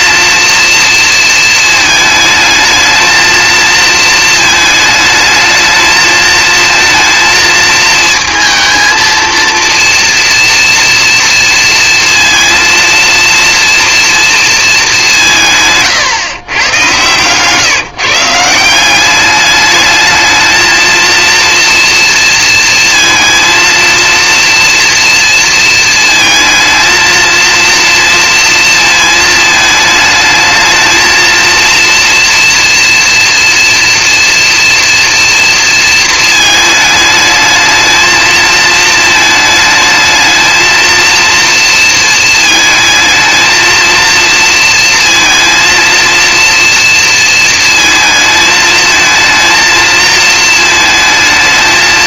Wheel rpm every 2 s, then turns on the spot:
230, 220, 220, 220, 230, 230, 230, 200, 120, 180, 220, 230, 240, 220, 220, 220, 230, 230, 220, 220, 230, 220, 230, 230, 220, 220.
none